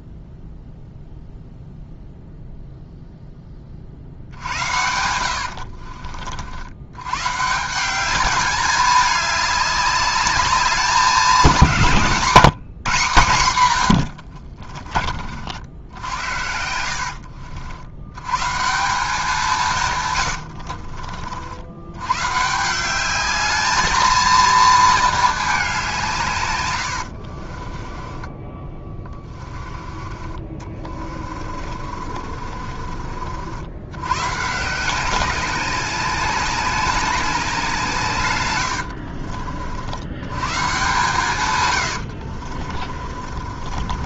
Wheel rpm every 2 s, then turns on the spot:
0, 0, 80, 90, 200, 200, 160, 50, 70, 170, 60, 180, 220, 90, 20, 40, 40, 180, 200, 80, 140, 40.
4-6 14-18 20-22 26-32 38-40 42-44